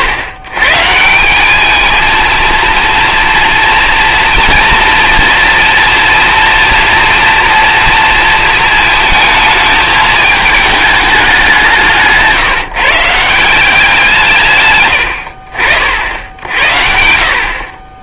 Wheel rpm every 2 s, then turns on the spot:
140, 230, 230, 230, 220, 210, 160, 120, 80.
none